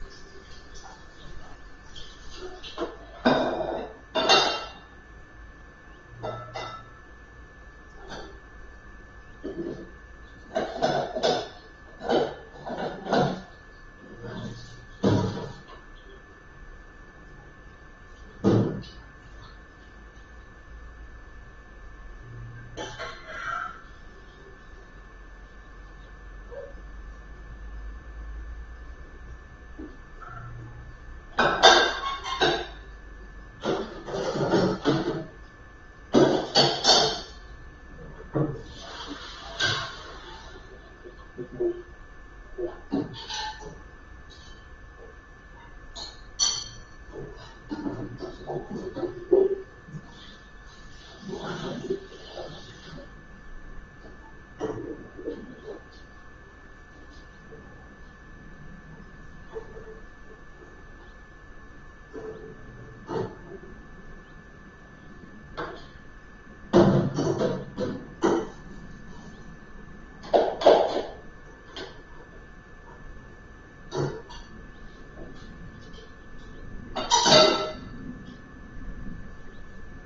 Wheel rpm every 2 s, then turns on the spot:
0, 0, 0, 0, 0, 0, 0, 0, 0, 0, 0, 0, 0, 0, 0, 0, 0, 0, 0, 0, 0, 0, 0, 0, 0, 0, 0, 0, 0, 0, 0, 0, 0, 0, 0, 0, 0, 0, 0, 0.
none